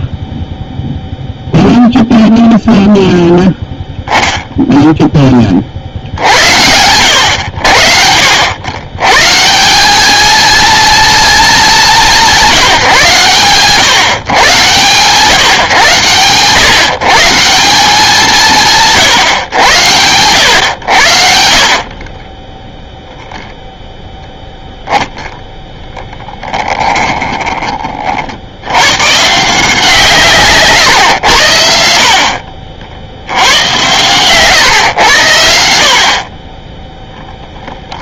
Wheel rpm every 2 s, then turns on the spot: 0, 0, 0, 90, 120, 220, 170, 120, 140, 170, 100, 0, 10, 20, 100, 130, 50, 120, 10.
26-28